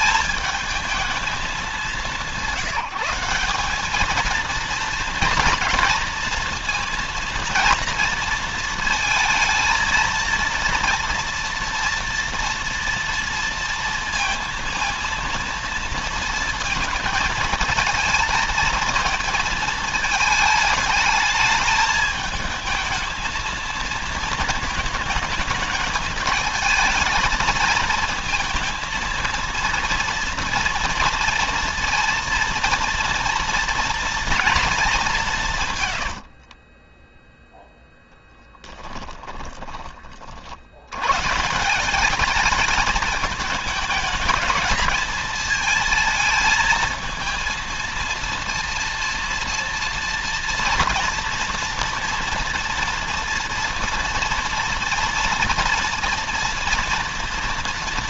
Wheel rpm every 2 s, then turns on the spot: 220, 180, 230, 230, 230, 240, 230, 230, 220, 220, 210, 220, 220, 220, 230, 230, 230, 180, 10, 20, 110, 210, 220, 230, 230, 240, 240, 230, 230.
36-40